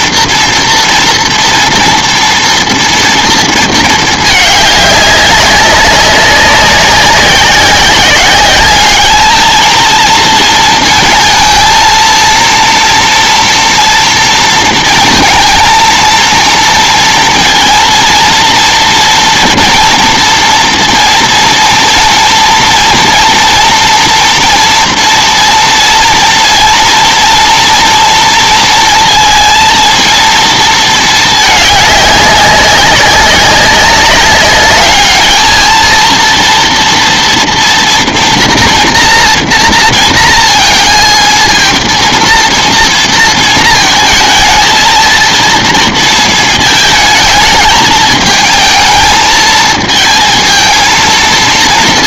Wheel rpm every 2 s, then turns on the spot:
240, 240, 210, 190, 210, 230, 230, 230, 230, 230, 230, 230, 230, 230, 230, 220, 190, 200, 230, 230, 230, 230, 220, 220, 220, 220.
none